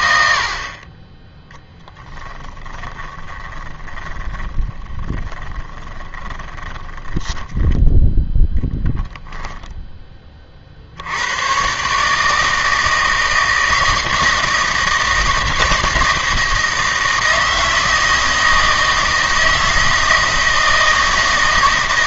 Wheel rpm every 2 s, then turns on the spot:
30, 20, 30, 10, 0, 70, 160, 160, 160, 160, 160.
2-8